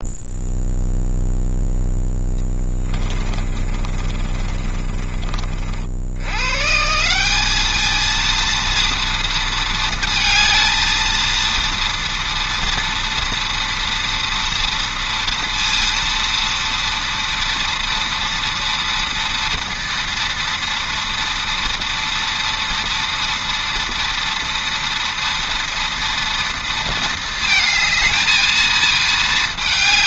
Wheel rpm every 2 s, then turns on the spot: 0, 10, 30, 140, 230, 220, 230, 230, 230, 230, 230, 230, 230, 230, 220.
2-6